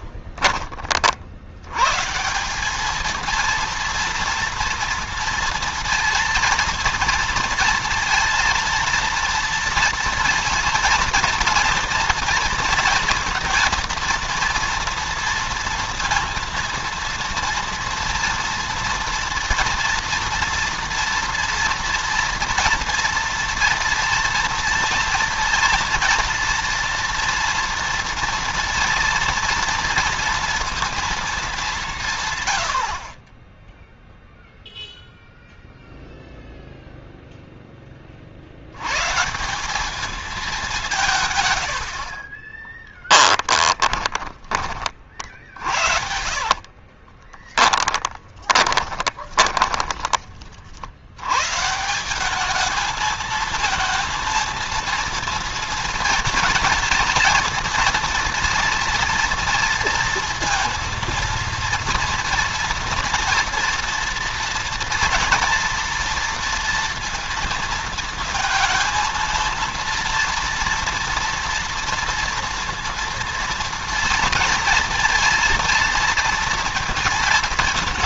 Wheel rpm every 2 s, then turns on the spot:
30, 200, 240, 230, 230, 230, 230, 230, 230, 230, 230, 230, 230, 240, 230, 230, 80, 0, 0, 110, 190, 20, 30, 40, 30, 70, 220, 230, 230, 230, 230, 240, 230, 230, 230, 230, 230, 230, 220.
42-44 46-50